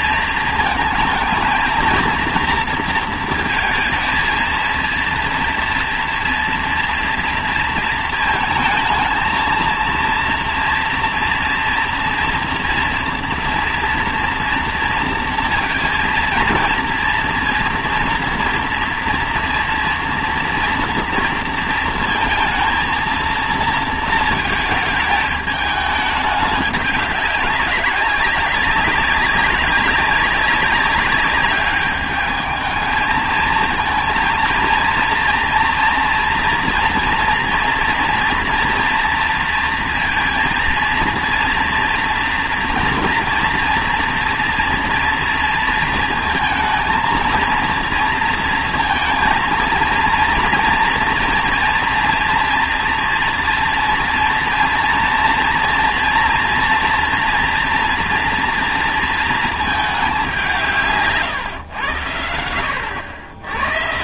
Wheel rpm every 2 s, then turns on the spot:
230, 230, 230, 230, 220, 230, 240, 230, 230, 240, 230, 230, 220, 200, 200, 190, 220, 230, 230, 240, 230, 230, 230, 230, 230, 230, 230, 230, 240, 230, 170, 90.
none